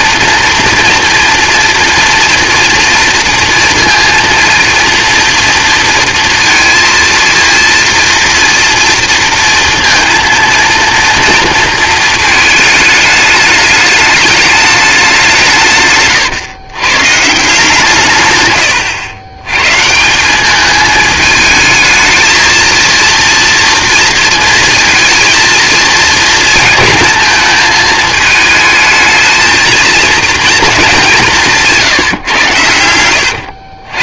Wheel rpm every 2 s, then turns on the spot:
230, 230, 230, 230, 230, 230, 210, 210, 120, 140, 210, 230, 230, 230, 220, 210, 110.
none